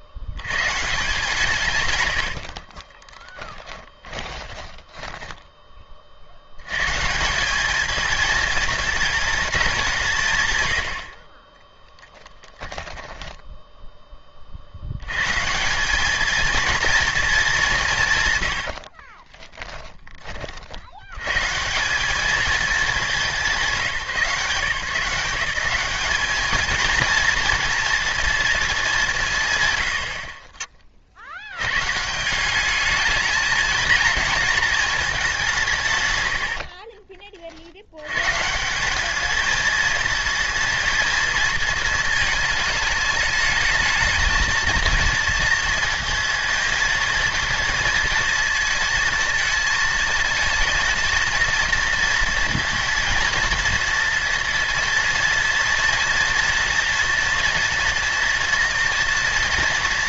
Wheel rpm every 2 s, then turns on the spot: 160, 40, 10, 130, 220, 70, 10, 70, 230, 60, 60, 210, 150, 230, 200, 30, 210, 220, 60, 190, 230, 210, 230, 230, 230, 230, 240, 230, 230, 230.
2-6 12-14 18-20 36-38